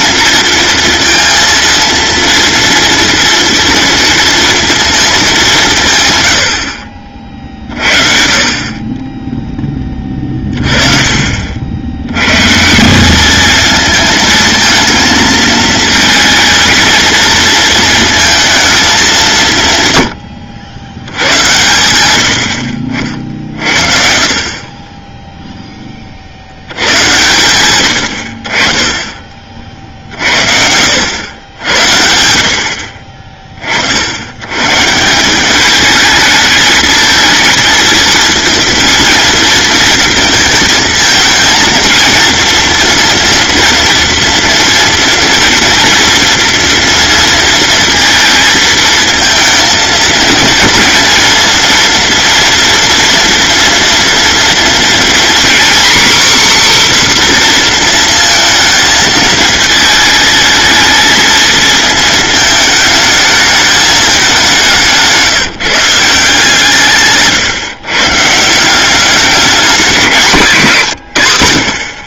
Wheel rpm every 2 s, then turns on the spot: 230, 230, 230, 50, 30, 30, 170, 230, 220, 200, 80, 60, 30, 100, 30, 90, 50, 150, 220, 230, 220, 230, 240, 230, 230, 230, 230, 240, 270, 220, 220, 220, 170, 150, 180, 160.
64-66